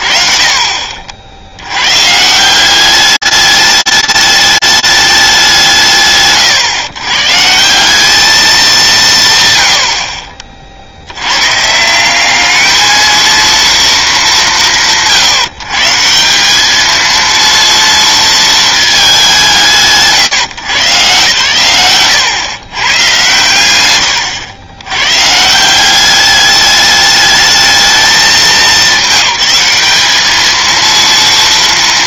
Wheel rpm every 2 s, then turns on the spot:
30, 120, 210, 140, 200, 40, 190, 220, 150, 230, 120, 120, 100, 200, 200, 210.
24-26